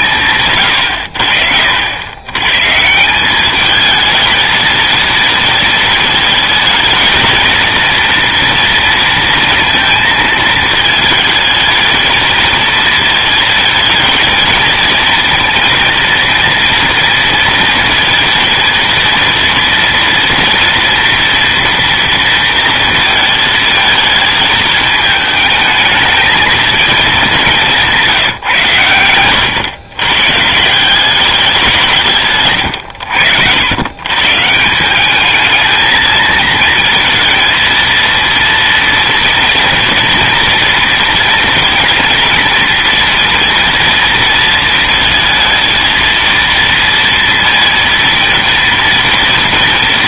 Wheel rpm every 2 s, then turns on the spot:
100, 150, 220, 220, 230, 220, 230, 230, 230, 230, 230, 230, 220, 220, 120, 170, 110, 170, 230, 230, 230, 230, 230, 230, 230.
none